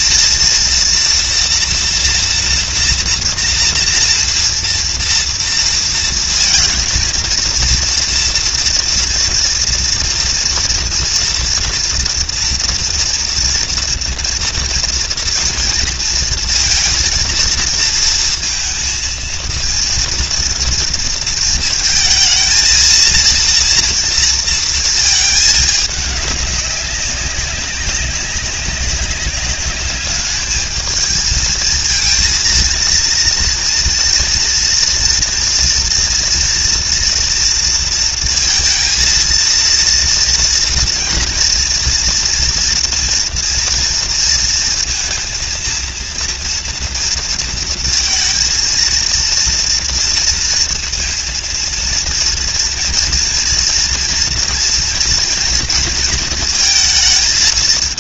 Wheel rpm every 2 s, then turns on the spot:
230, 230, 230, 230, 230, 230, 230, 230, 230, 230, 230, 230, 230, 200, 200, 220, 230, 230, 240, 230, 230, 230, 230, 230, 220, 230, 230, 240, 230.
none